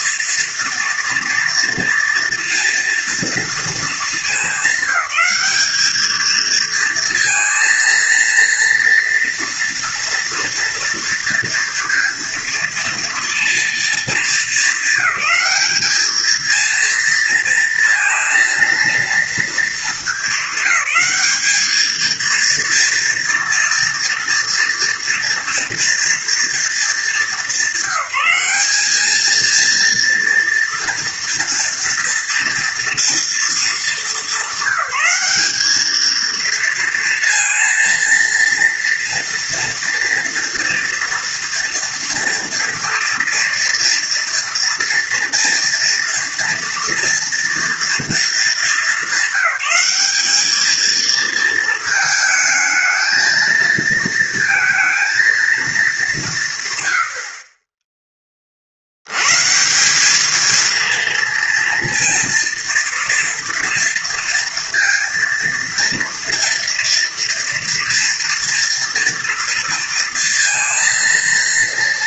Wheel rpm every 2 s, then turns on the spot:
230, 230, 200, 230, 230, 230, 230, 220, 220, 230, 220, 230, 240, 230, 200, 230, 230, 210, 230, 230, 230, 230, 230, 230, 220, 210, 220, 230, 150, 40, 220, 230, 230, 230, 230, 230.
none